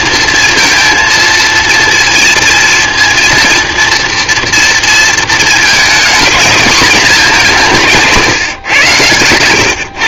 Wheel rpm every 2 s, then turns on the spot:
230, 230, 230, 220, 140.
none